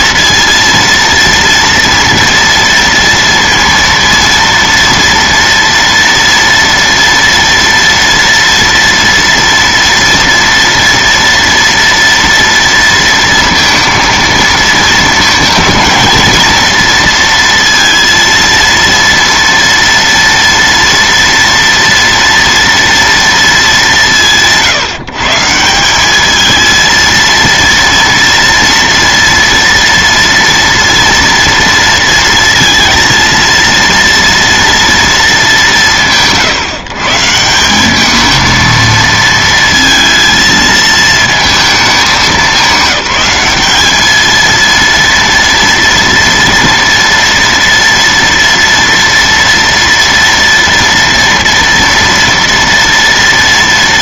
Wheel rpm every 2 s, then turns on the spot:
230, 230, 230, 230, 230, 230, 230, 220, 230, 230, 230, 230, 150, 230, 230, 230, 230, 220, 140, 230, 220, 200, 230, 230, 230, 230, 230.
none